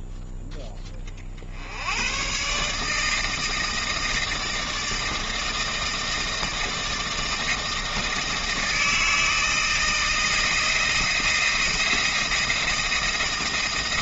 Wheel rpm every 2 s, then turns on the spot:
10, 140, 160, 160, 160, 160, 160.
none